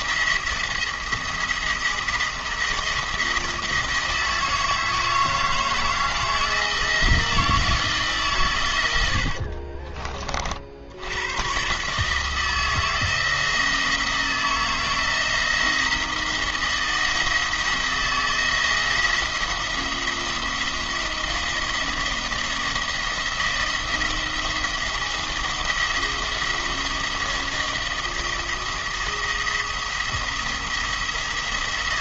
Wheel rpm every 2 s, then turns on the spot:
170, 170, 160, 170, 120, 60, 160, 170, 170, 170, 170, 170, 170, 170, 170, 170.
none